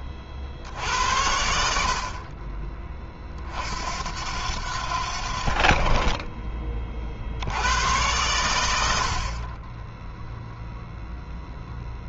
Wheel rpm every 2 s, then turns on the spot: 80, 40, 80, 40, 70, 0.
none